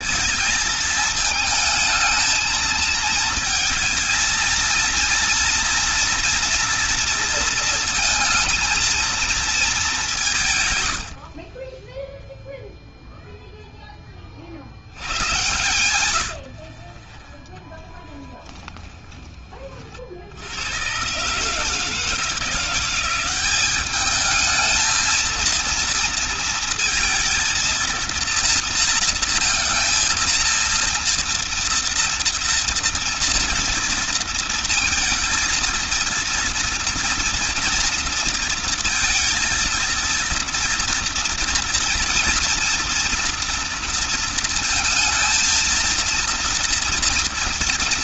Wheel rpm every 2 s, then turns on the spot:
220, 220, 230, 230, 230, 90, 0, 90, 20, 20, 120, 180, 230, 230, 230, 230, 230, 230, 230, 230, 230, 230, 230, 230.
none